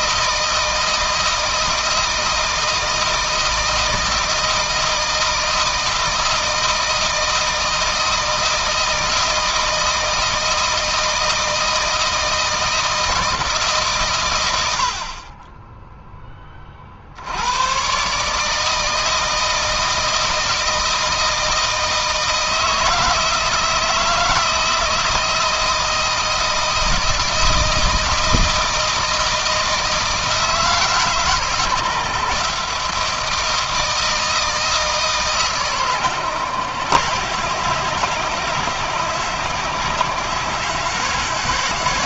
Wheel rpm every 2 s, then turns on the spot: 160, 160, 160, 160, 160, 160, 170, 60, 50, 160, 160, 160, 170, 160, 160, 160, 160, 160, 120, 120, 140.
none